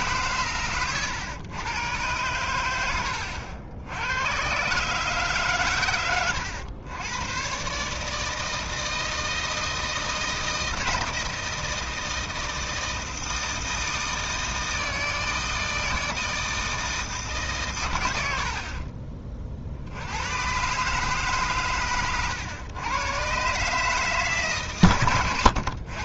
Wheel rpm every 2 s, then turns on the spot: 120, 100, 130, 110, 160, 160, 160, 160, 160, 50, 130, 110, 130.
18-20